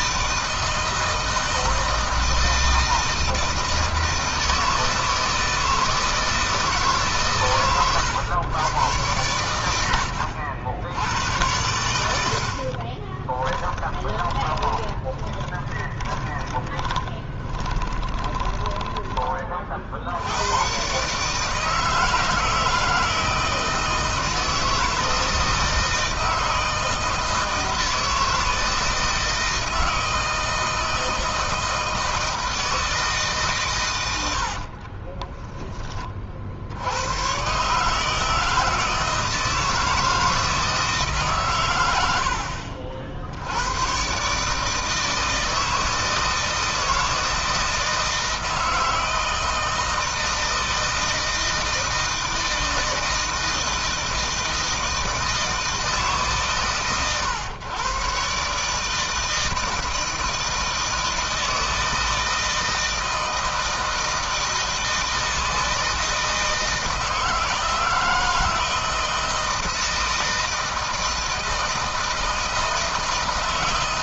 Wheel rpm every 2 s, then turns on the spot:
160, 160, 160, 160, 110, 80, 50, 20, 20, 30, 110, 160, 160, 160, 160, 160, 160, 60, 70, 160, 160, 60, 150, 160, 160, 160, 160, 160, 140, 140, 160, 160, 160, 160, 160, 160, 160.
12-20 34-36